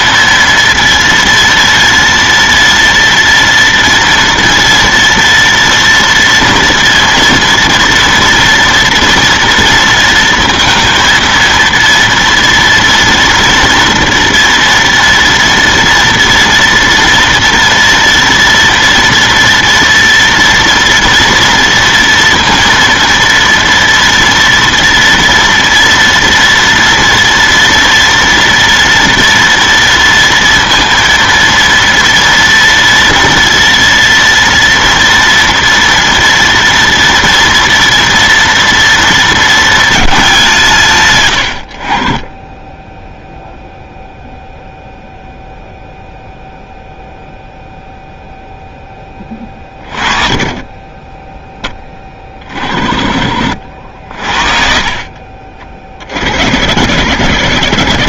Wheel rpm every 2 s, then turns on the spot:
230, 230, 230, 230, 240, 230, 230, 230, 230, 230, 230, 230, 230, 230, 230, 230, 230, 230, 230, 230, 130, 10, 0, 0, 10, 10, 40, 50, 70.
none